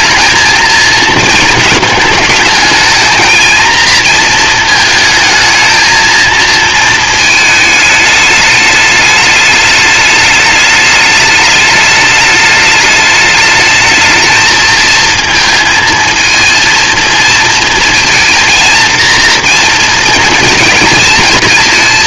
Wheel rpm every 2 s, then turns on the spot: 220, 220, 230, 230, 210, 210, 210, 220, 230, 230, 230.
none